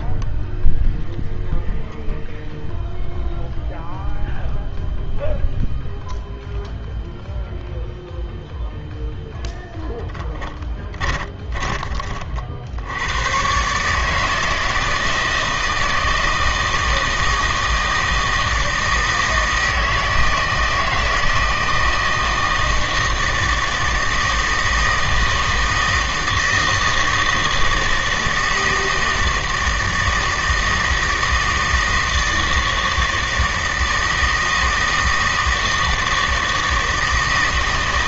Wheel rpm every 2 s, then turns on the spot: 0, 0, 0, 0, 0, 10, 50, 160, 160, 160, 160, 160, 160, 160, 160, 160, 160, 160, 160.
10-12